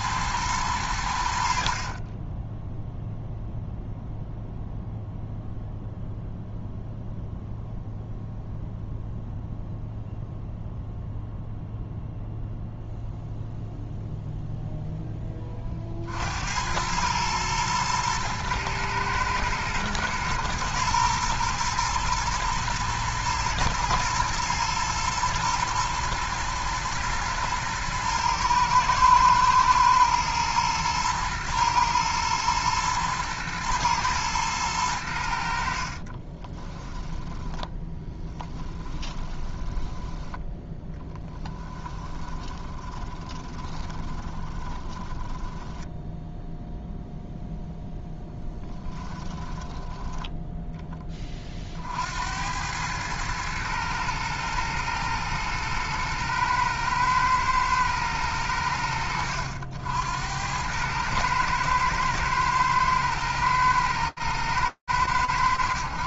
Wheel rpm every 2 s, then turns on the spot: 110, 0, 0, 0, 0, 0, 0, 0, 90, 110, 110, 120, 110, 120, 120, 110, 120, 110, 30, 20, 10, 20, 30, 0, 10, 20, 90, 110, 110, 100, 90, 110, 110.
36-40 42-46